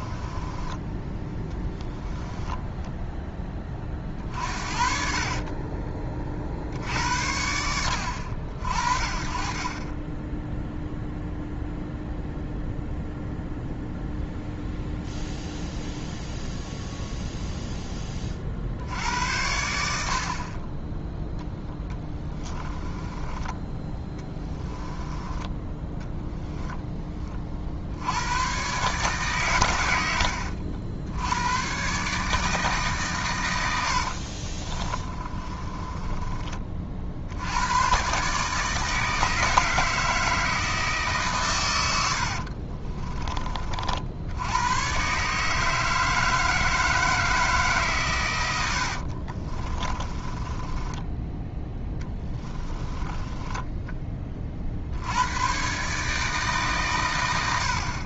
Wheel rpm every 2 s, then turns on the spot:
20, 10, 50, 60, 60, 0, 0, 0, 0, 60, 20, 20, 20, 10, 130, 70, 150, 40, 40, 150, 160, 30, 110, 160, 90, 20, 20, 50, 130.
0-4 22-26 34-36 42-44 48-54